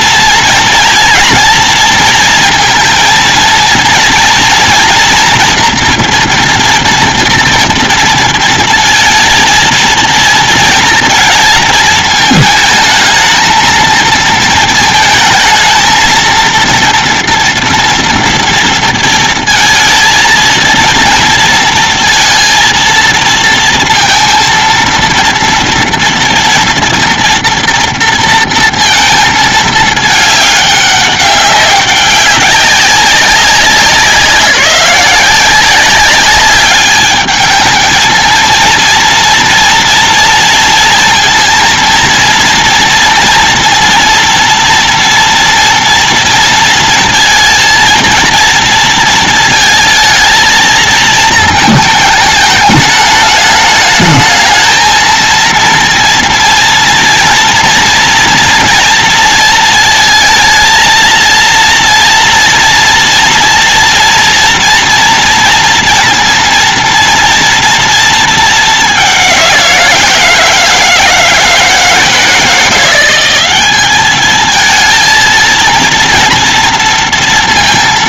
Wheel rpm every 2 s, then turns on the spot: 230, 230, 230, 240, 230, 230, 220, 230, 230, 230, 230, 230, 230, 230, 230, 210, 190, 180, 200, 220, 230, 230, 230, 230, 230, 220, 210, 210, 230, 240, 230, 230, 230, 230, 220, 170, 170, 210, 230.
none